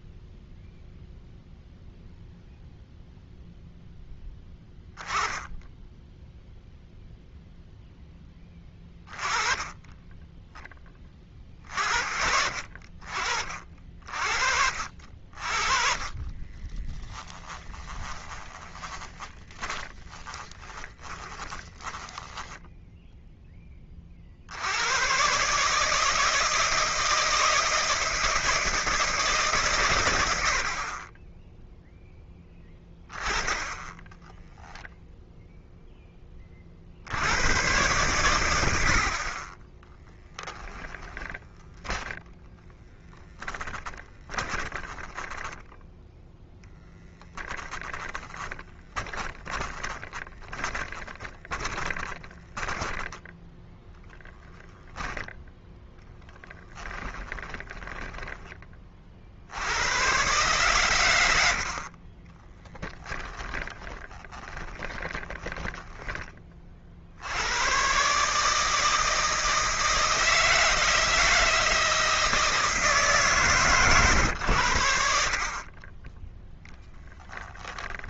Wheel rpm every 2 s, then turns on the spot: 0, 0, 10, 0, 10, 10, 60, 50, 20, 10, 20, 0, 80, 160, 160, 50, 10, 0, 60, 80, 10, 10, 10, 0, 10, 20, 20, 10, 20, 30, 120, 10, 20, 40, 160, 170, 160, 90, 0.
16-22 40-44 48-58 62-66